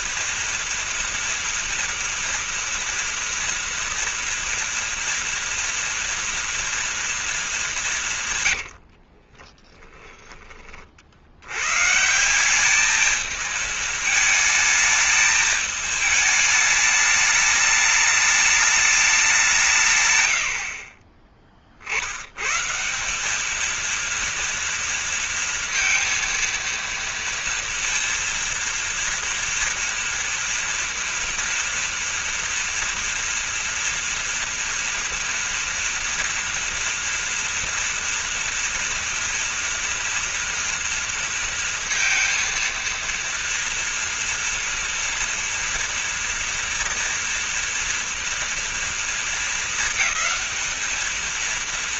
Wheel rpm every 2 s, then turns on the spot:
230, 230, 230, 230, 140, 20, 180, 220, 220, 210, 100, 100, 230, 230, 230, 230, 230, 230, 230, 230, 230, 230, 230, 230, 230, 220.
8-10